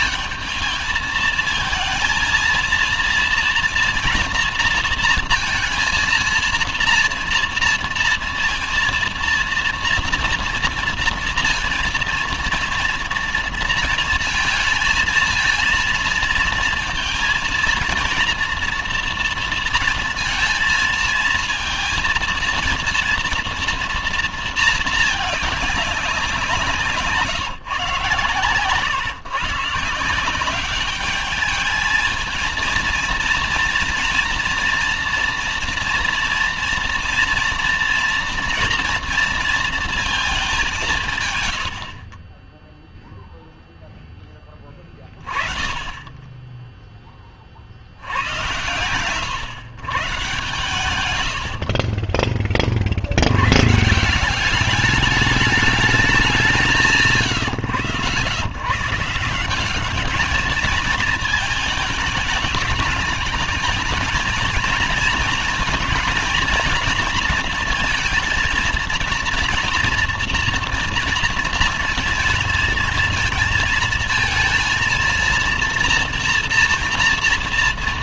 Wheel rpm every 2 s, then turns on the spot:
220, 230, 230, 230, 230, 230, 230, 230, 230, 230, 230, 230, 230, 170, 120, 190, 230, 240, 240, 240, 200, 20, 20, 10, 100, 130, 30, 190, 170, 110, 220, 210, 230, 230, 220, 240, 230, 230, 230.
none